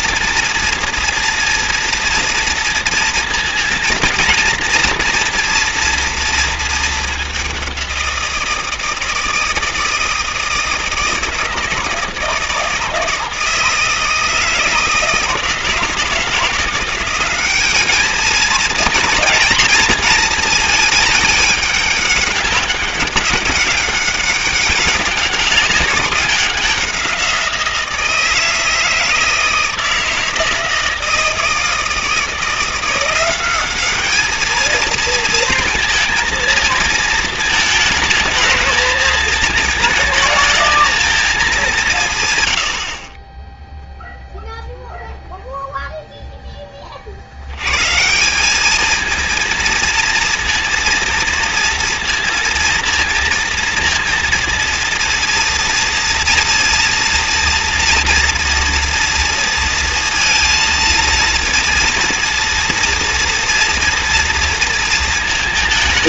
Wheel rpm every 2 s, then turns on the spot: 230, 230, 230, 210, 160, 160, 160, 160, 180, 230, 210, 200, 190, 180, 160, 160, 180, 230, 230, 220, 220, 40, 0, 40, 220, 230, 230, 230, 230, 230, 230, 230, 230.
none